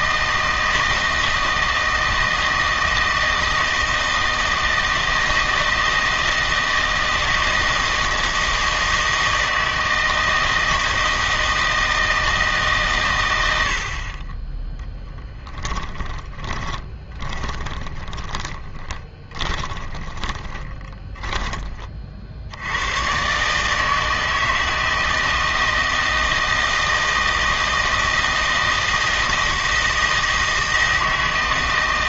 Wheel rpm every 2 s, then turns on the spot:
160, 160, 160, 160, 160, 160, 140, 10, 20, 20, 20, 90, 160, 160, 160, 160.
16-22